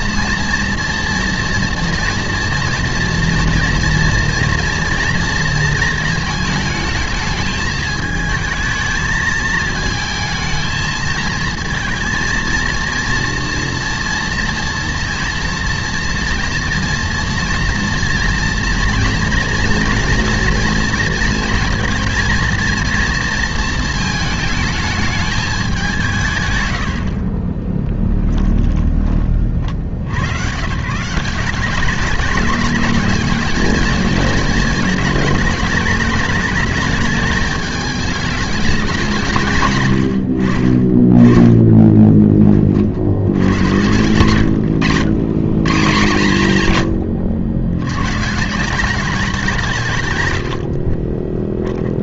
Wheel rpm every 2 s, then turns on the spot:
230, 240, 230, 220, 220, 220, 230, 230, 230, 230, 230, 230, 220, 120, 10, 120, 210, 220, 210, 210, 50, 30, 100, 150, 180, 70.
28-30 44-46 50-52